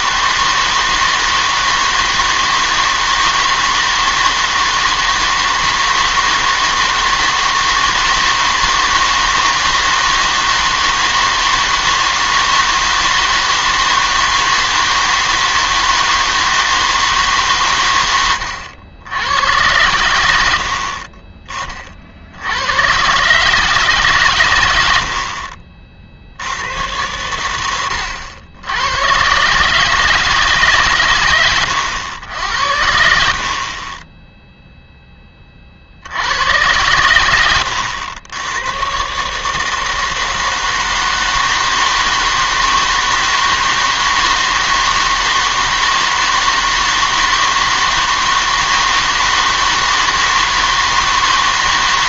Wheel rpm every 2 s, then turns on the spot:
160, 160, 160, 160, 160, 160, 160, 160, 160, 80, 60, 100, 100, 100, 100, 140, 80, 0, 100, 110, 160, 160, 160, 160, 160, 160.
none